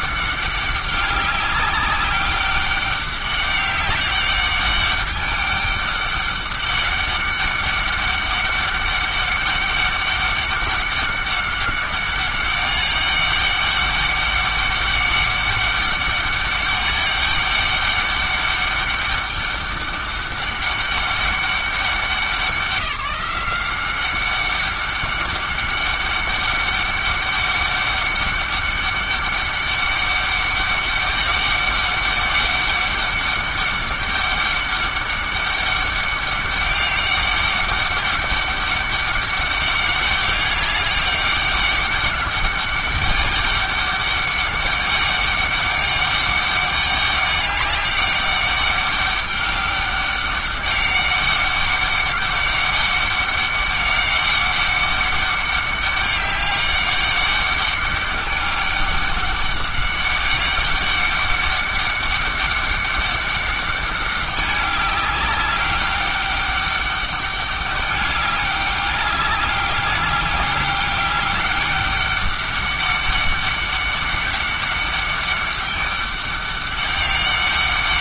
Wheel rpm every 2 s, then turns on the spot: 200, 200, 200, 200, 200, 200, 200, 200, 200, 200, 200, 180, 200, 200, 200, 200, 200, 200, 200, 200, 200, 200, 200, 200, 200, 200, 190, 200, 200, 200, 200, 200, 200, 200, 200, 200, 200, 200, 200.
none